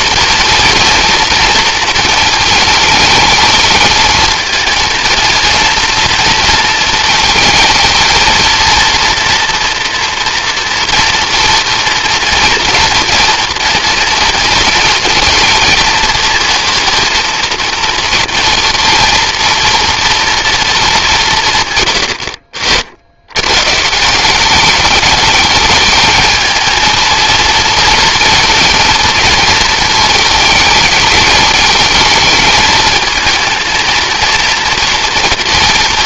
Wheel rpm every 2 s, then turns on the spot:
230, 220, 230, 220, 230, 230, 230, 230, 230, 230, 220, 60, 210, 220, 220, 220, 220, 230.
none